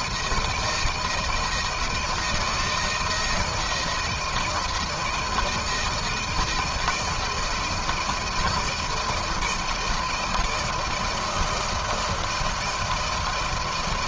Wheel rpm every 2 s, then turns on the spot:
170, 170, 160, 160, 160, 160, 160.
none